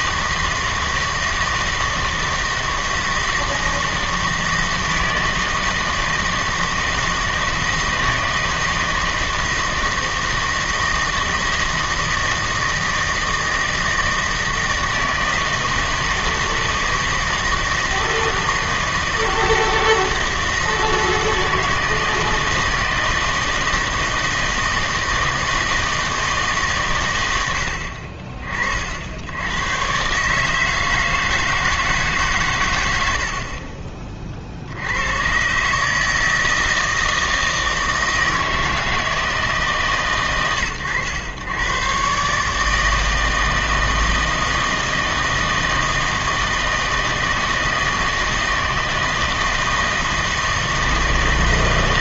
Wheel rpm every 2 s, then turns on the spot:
160, 160, 160, 160, 160, 160, 160, 160, 160, 160, 160, 160, 160, 140, 50, 160, 110, 70, 160, 160, 110, 150, 160, 160, 160, 160.
none